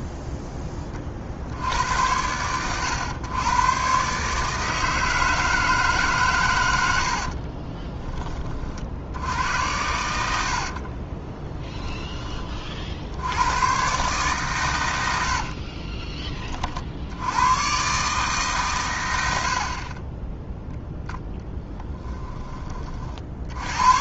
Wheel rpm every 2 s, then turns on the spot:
20, 110, 160, 80, 60, 50, 70, 110, 50, 120, 0, 30.
10-12